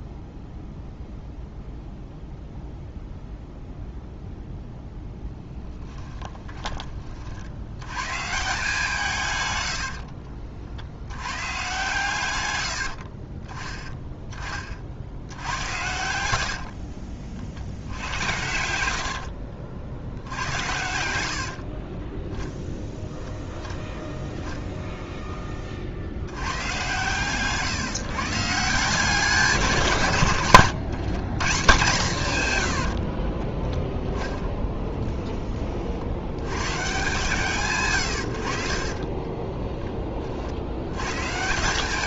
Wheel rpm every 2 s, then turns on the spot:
0, 0, 0, 30, 160, 50, 90, 50, 60, 90, 80, 10, 0, 120, 170, 120, 90, 10, 140, 40, 90.
16-22 32-34 38-40